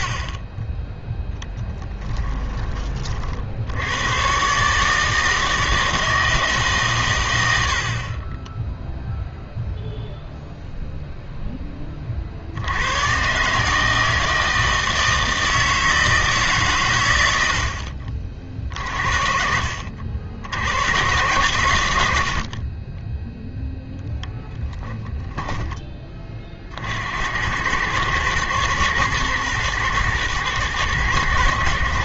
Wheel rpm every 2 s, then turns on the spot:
20, 30, 140, 150, 10, 0, 80, 160, 130, 50, 100, 40, 10, 40, 120, 110.
24-26